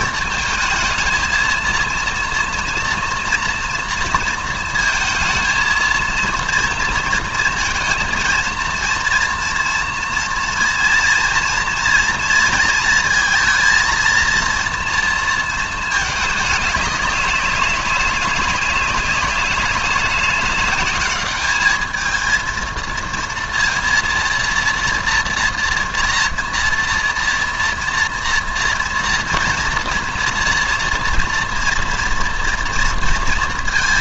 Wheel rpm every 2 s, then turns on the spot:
220, 230, 230, 230, 230, 230, 230, 230, 200, 190, 200, 230, 230, 230, 230, 230, 230.
none